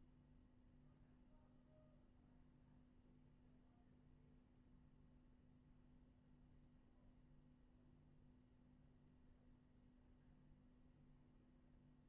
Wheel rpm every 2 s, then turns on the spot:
0, 0, 0, 0, 0, 0.
none